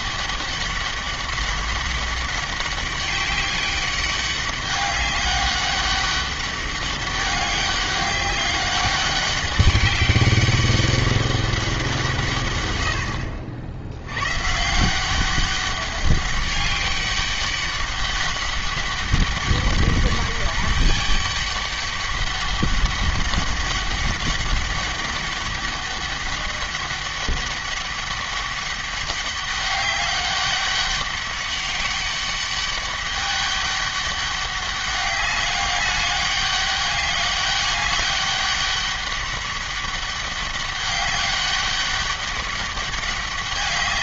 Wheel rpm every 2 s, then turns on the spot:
200, 200, 200, 200, 200, 200, 100, 160, 200, 200, 200, 200, 200, 200, 200, 200, 200, 200, 200, 200, 200, 200.
none